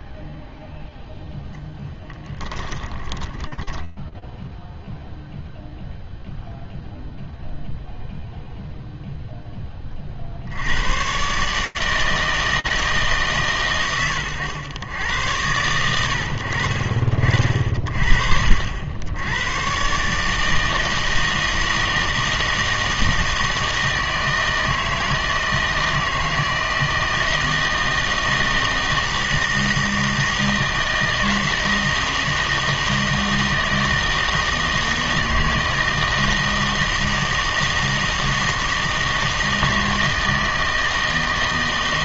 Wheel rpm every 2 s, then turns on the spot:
0, 20, 0, 0, 0, 150, 120, 100, 50, 110, 160, 160, 160, 160, 160, 160, 160, 160, 160, 160, 160.
2-4